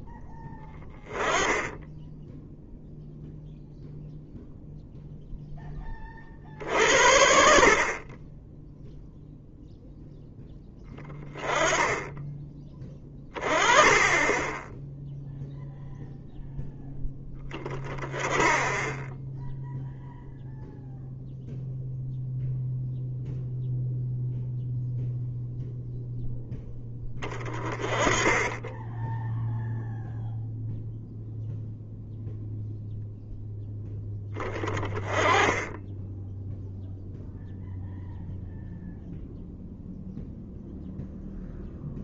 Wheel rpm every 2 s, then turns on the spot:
10, 0, 0, 60, 0, 10, 20, 10, 10, 10, 0, 0, 0, 10, 10, 0, 0, 20, 0, 0, 0.
none